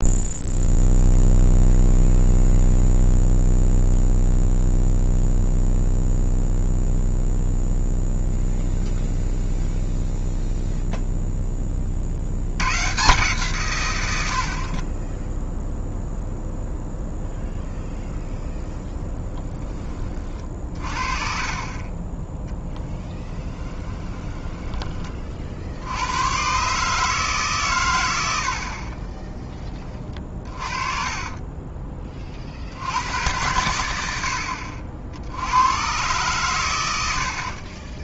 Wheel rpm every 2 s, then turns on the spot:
0, 0, 0, 0, 0, 0, 130, 40, 0, 0, 40, 20, 30, 140, 30, 30, 70, 50, 100.
22-24 30-32